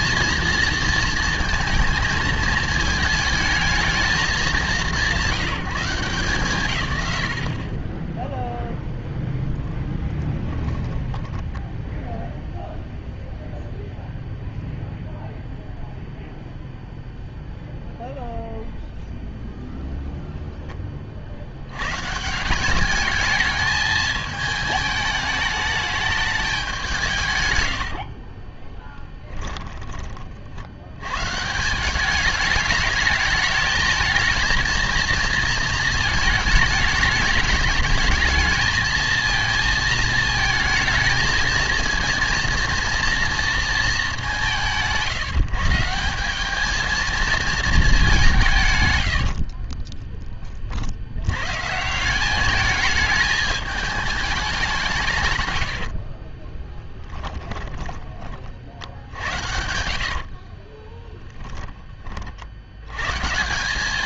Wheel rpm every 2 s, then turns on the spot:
230, 220, 200, 150, 0, 10, 0, 0, 0, 0, 0, 170, 210, 200, 20, 60, 210, 230, 210, 220, 220, 230, 180, 210, 150, 40, 210, 190, 30, 50, 30, 70.
10-12 28-30 56-58 60-62